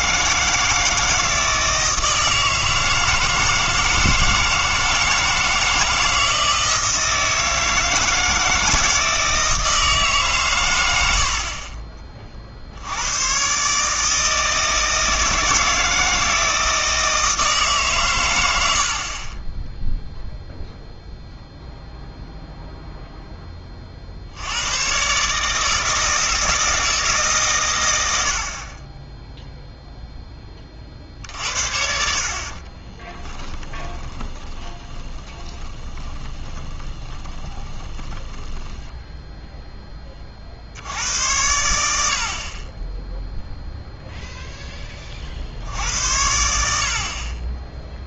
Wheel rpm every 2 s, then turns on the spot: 160, 160, 160, 160, 160, 100, 70, 160, 160, 80, 0, 0, 100, 160, 40, 40, 30, 30, 20, 10, 70, 20, 20, 80.
32-40